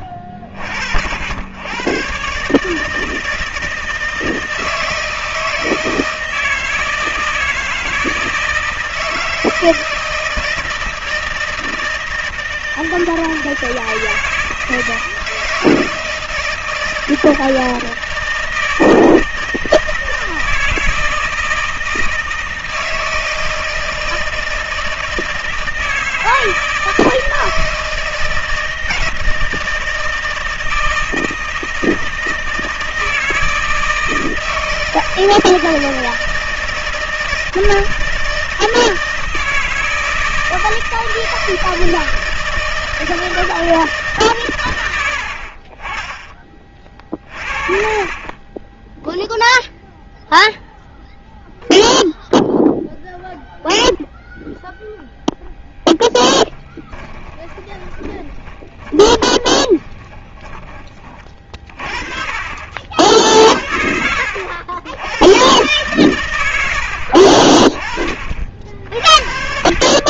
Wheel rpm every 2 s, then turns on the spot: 50, 140, 160, 160, 160, 160, 160, 160, 160, 160, 160, 160, 160, 160, 160, 160, 160, 160, 160, 160, 160, 160, 120, 30, 20, 0, 0, 0, 10, 20, 30, 40, 70, 80, 40.
56-62